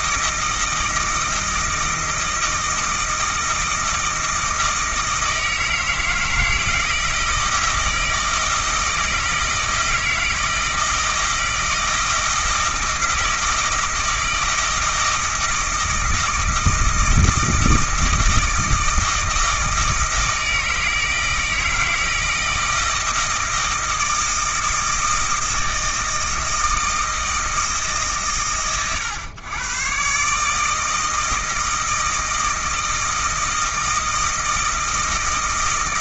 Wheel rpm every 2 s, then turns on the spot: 160, 160, 160, 160, 160, 160, 160, 160, 160, 160, 160, 160, 160, 160, 100, 150, 160, 160.
none